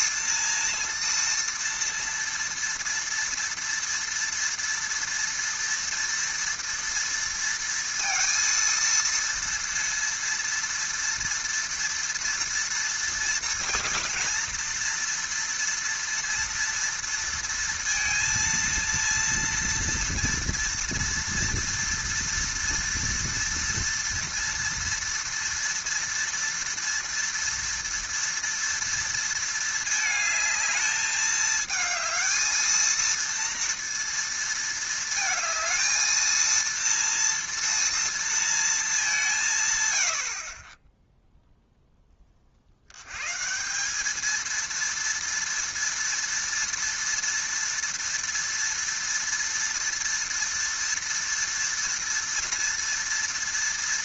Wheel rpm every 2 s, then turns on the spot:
230, 230, 230, 230, 230, 230, 230, 230, 230, 230, 240, 230, 230, 230, 230, 220, 230, 230, 230, 220, 20, 40, 230, 230, 230, 230, 230.
none